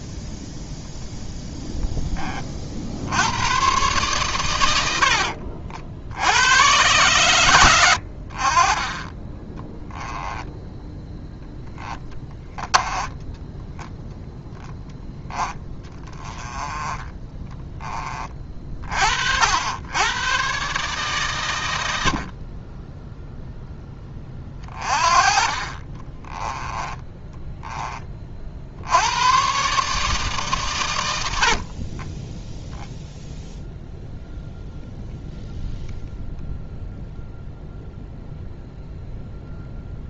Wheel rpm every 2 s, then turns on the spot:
0, 40, 110, 110, 30, 10, 10, 0, 20, 40, 130, 30, 30, 10, 70, 130, 0, 0, 0, 0.
12-14 26-28